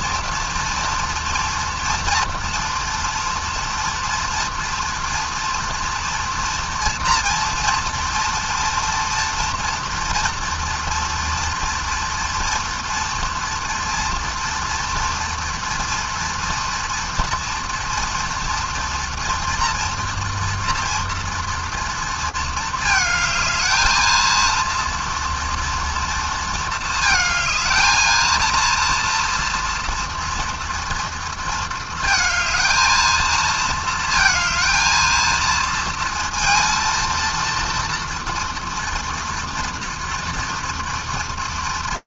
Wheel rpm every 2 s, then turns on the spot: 230, 230, 230, 230, 240, 240, 230, 230, 230, 230, 240, 220, 230, 220, 230, 230, 220, 220, 230, 230, 230.
none